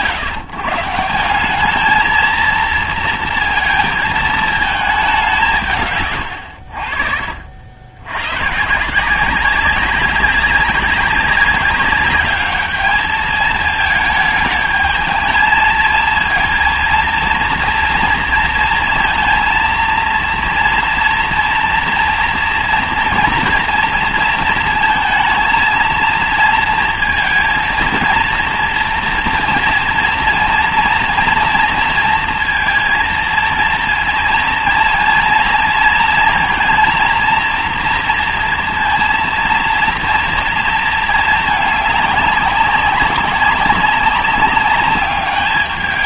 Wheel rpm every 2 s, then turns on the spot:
160, 230, 220, 80, 160, 200, 210, 220, 230, 230, 230, 230, 220, 230, 230, 230, 230, 230, 230, 230, 230, 200, 200.
none